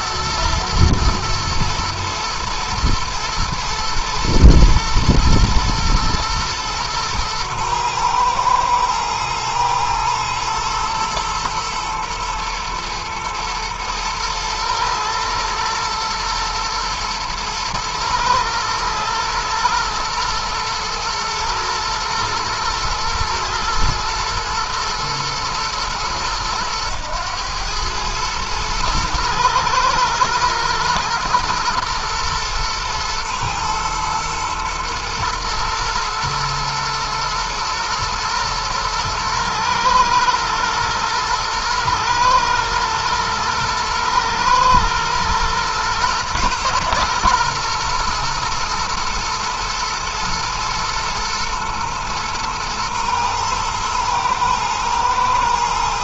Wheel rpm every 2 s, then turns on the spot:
120, 110, 110, 110, 110, 110, 110, 110, 110, 110, 110, 110, 110, 110, 110, 120, 110, 110, 110, 120, 120, 110, 120, 120, 110, 120, 120, 110.
none